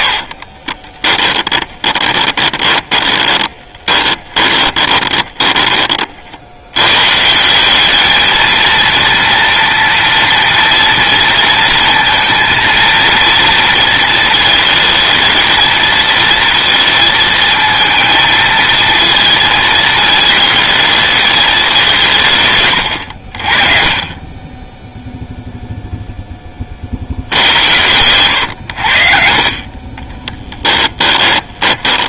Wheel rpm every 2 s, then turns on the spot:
70, 20, 20, 90, 220, 230, 230, 220, 230, 220, 220, 130, 10, 50, 60, 10.
0-6 30-32